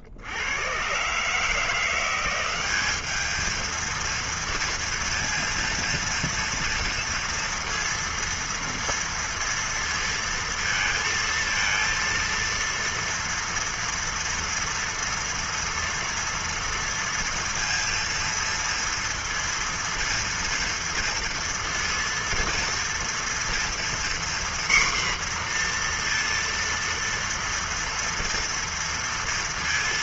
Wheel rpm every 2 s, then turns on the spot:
110, 190, 230, 230, 230, 230, 230, 230, 230, 230, 240, 230, 250, 230, 230.
none